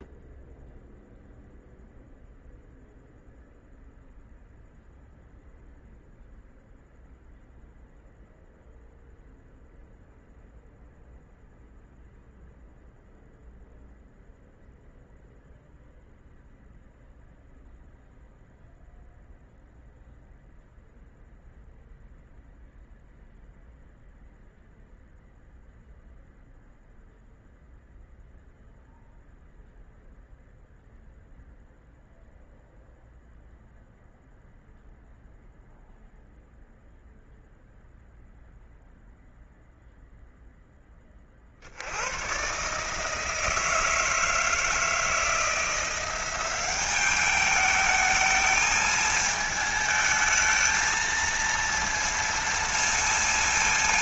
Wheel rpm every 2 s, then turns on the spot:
0, 0, 0, 0, 0, 0, 0, 0, 0, 0, 0, 0, 0, 0, 0, 0, 0, 0, 0, 0, 10, 130, 160, 190, 220, 220, 230.
none